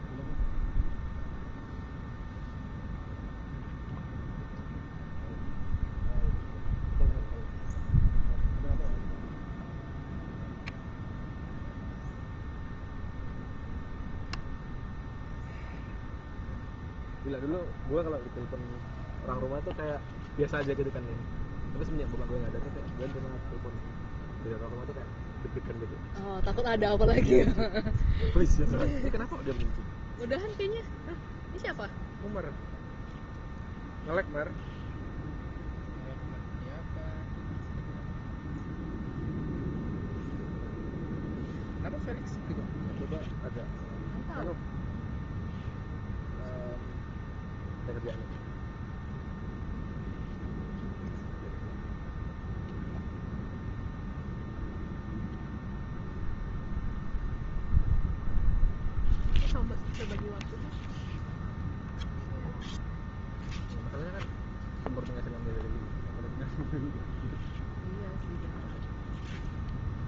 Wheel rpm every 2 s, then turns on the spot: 0, 0, 0, 0, 0, 0, 0, 0, 0, 0, 0, 0, 0, 0, 0, 0, 0, 0, 0, 0, 0, 0, 0, 0, 0, 0, 0, 0, 0, 0, 0, 0, 0, 0, 0.
none